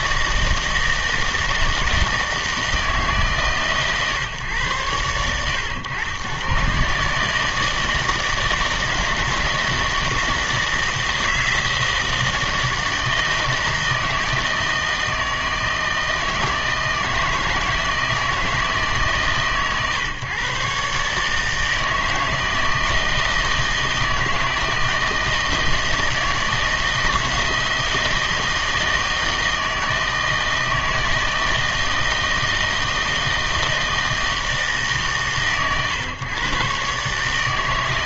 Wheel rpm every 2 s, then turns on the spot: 160, 160, 110, 140, 160, 170, 160, 160, 160, 150, 140, 160, 160, 160, 160, 160, 160, 150, 140.
none